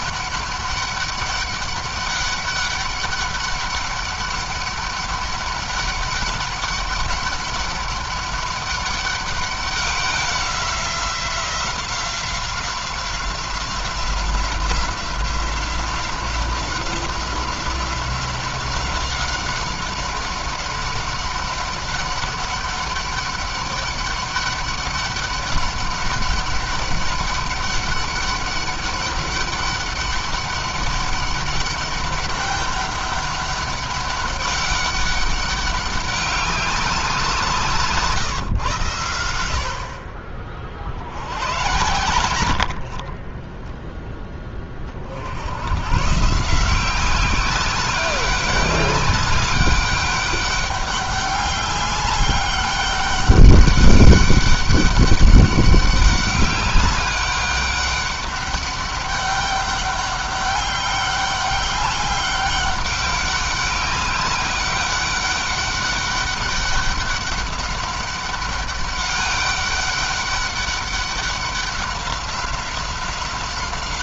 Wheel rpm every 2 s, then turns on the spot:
200, 200, 200, 200, 200, 180, 180, 180, 190, 190, 190, 200, 200, 200, 200, 200, 200, 200, 190, 120, 60, 60, 30, 180, 200, 200, 200, 200, 200, 200, 200, 200, 200, 200, 200, 200, 190.
none